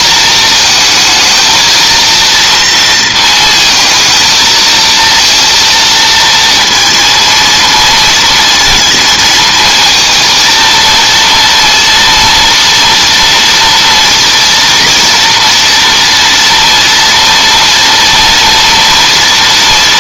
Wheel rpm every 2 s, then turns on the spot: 220, 230, 230, 230, 230, 230, 230, 230, 230, 240.
none